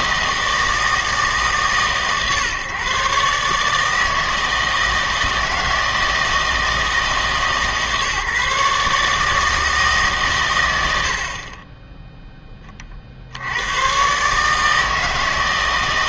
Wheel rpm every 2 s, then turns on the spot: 160, 130, 160, 160, 150, 100, 30, 160.
none